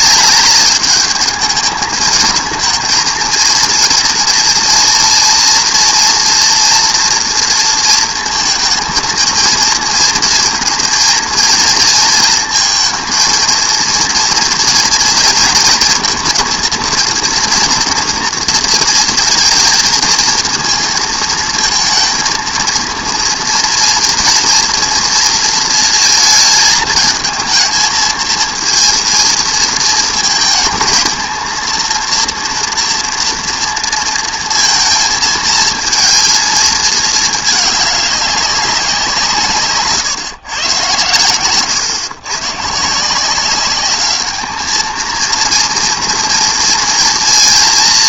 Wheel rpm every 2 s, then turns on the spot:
210, 220, 230, 240, 230, 230, 230, 230, 230, 230, 230, 230, 230, 220, 230, 230, 240, 230, 220, 190, 110, 130, 220, 230.
none